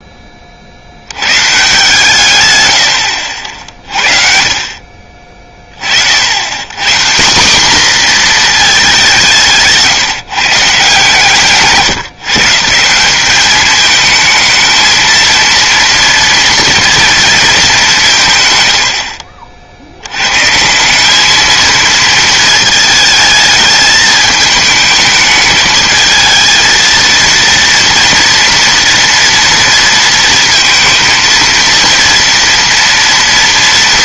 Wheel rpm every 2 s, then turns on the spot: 50, 100, 40, 150, 220, 150, 140, 220, 230, 100, 160, 220, 210, 230, 230, 230, 230.
none